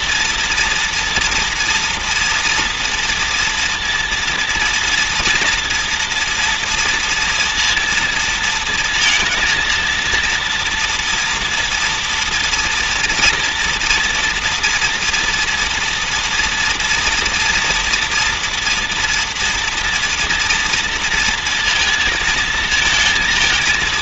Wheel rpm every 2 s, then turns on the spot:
230, 240, 230, 230, 220, 230, 230, 240, 240, 240, 230, 230.
none